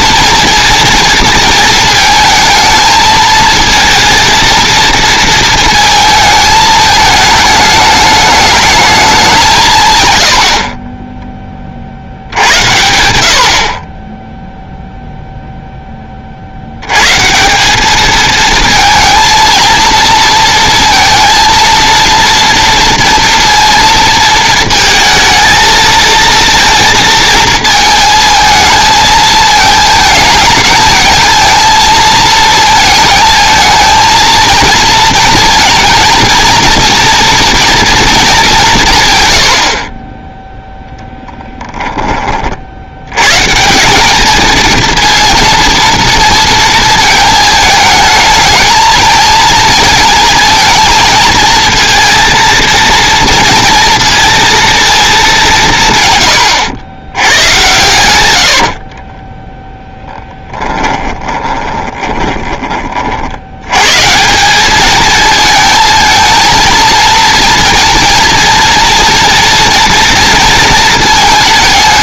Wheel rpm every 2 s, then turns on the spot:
230, 220, 230, 220, 210, 40, 90, 0, 110, 230, 230, 240, 230, 230, 220, 220, 220, 230, 230, 160, 10, 70, 230, 230, 220, 230, 230, 230, 100, 50, 10, 30, 210, 230, 230, 230.
40-42 58-62